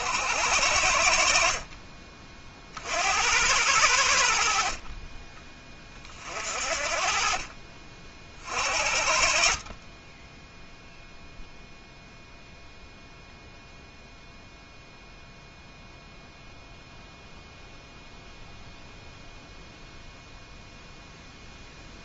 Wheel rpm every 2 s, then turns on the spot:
80, 40, 50, 40, 50, 0, 0, 0, 0, 0, 0.
none